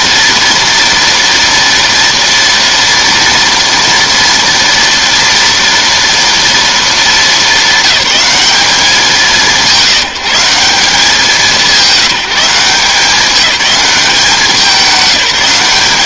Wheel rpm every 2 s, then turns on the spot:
230, 230, 230, 230, 210, 190, 180, 200.
none